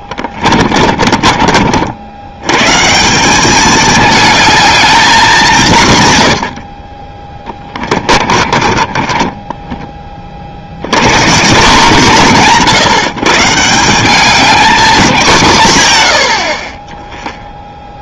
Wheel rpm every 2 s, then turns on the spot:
40, 150, 220, 70, 30, 80, 150, 210, 30.
0-2 8-10